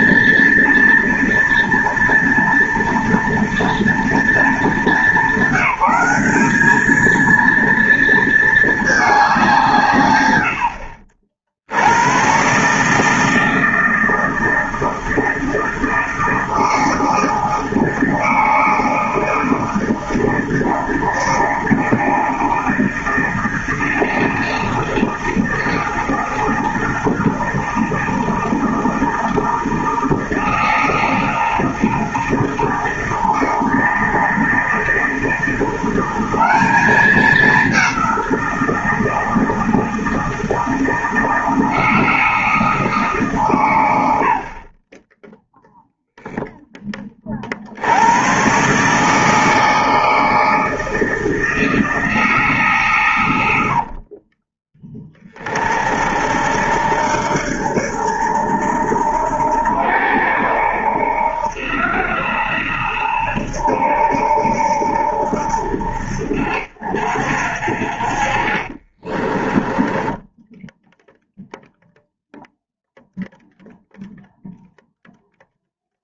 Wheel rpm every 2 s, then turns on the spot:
230, 230, 210, 220, 210, 70, 150, 160, 160, 160, 160, 160, 160, 160, 160, 160, 160, 160, 200, 160, 160, 150, 20, 20, 150, 160, 120, 20, 70, 80, 80, 80, 70, 60, 30, 0, 0, 0.
68-70